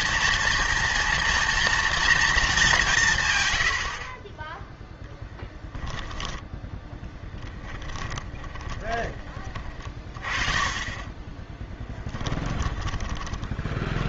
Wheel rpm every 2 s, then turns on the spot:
230, 190, 10, 10, 10, 30, 10.
8-10 12-14